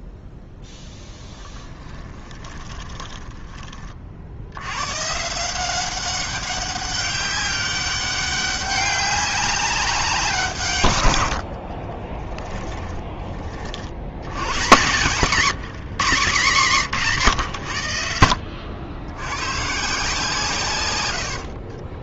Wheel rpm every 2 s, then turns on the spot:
10, 10, 120, 200, 200, 130, 20, 120, 130, 80, 110.
2-4 12-14